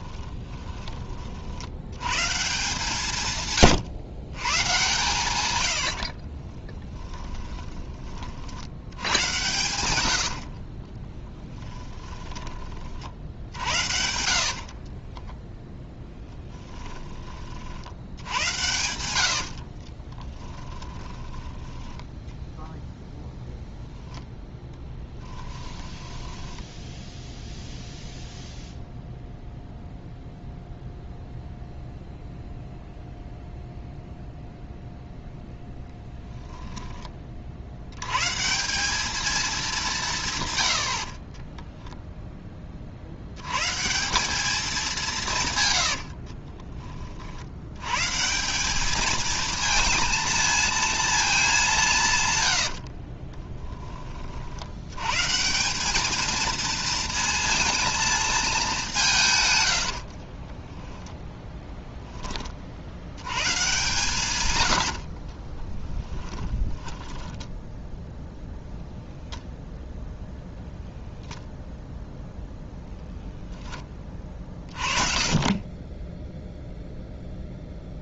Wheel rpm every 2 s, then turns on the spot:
10, 160, 120, 40, 70, 50, 30, 50, 10, 100, 10, 0, 10, 10, 0, 0, 0, 0, 20, 160, 120, 30, 200, 30, 170, 230, 90, 70, 230, 210, 20, 30, 100, 10, 0, 0, 0, 30, 0.
0-2 6-8 10-12 14-22 26-28 36-38 46-48 52-54 60-62 66-68